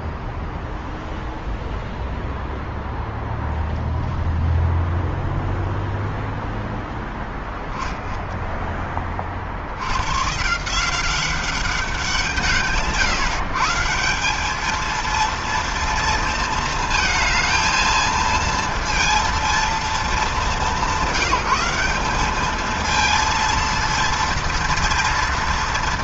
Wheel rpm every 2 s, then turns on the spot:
0, 0, 0, 0, 80, 190, 140, 230, 220, 230, 180, 230, 230.
none